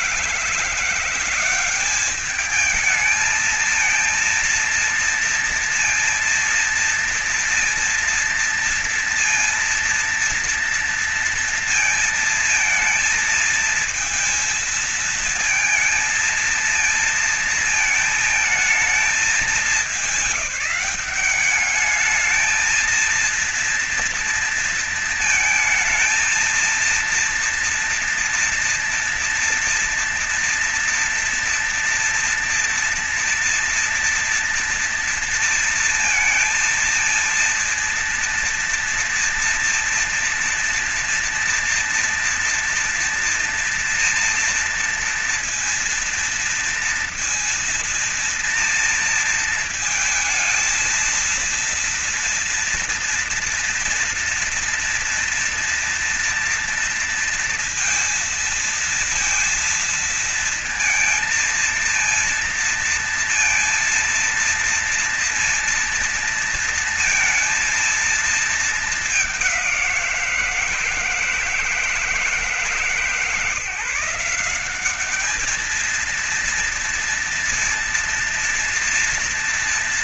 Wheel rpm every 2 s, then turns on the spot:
170, 210, 230, 230, 230, 230, 230, 230, 230, 210, 180, 220, 230, 230, 230, 230, 230, 230, 230, 230, 230, 230, 230, 230, 230, 230, 230, 230, 230, 230, 230, 230, 230, 230, 220, 170, 150, 200, 230, 230.
none